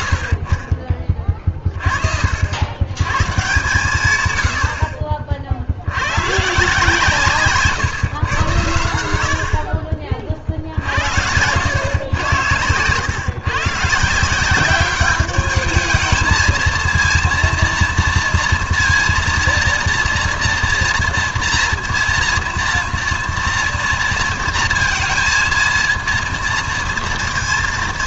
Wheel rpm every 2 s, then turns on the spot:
40, 90, 80, 160, 100, 60, 110, 190, 220, 230, 230, 230, 230, 230.
none